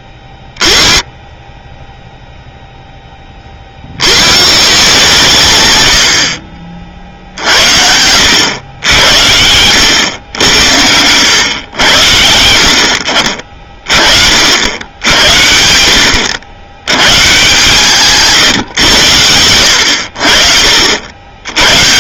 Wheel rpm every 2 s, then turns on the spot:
20, 0, 140, 50, 100, 90, 70, 80, 100, 120, 60.
none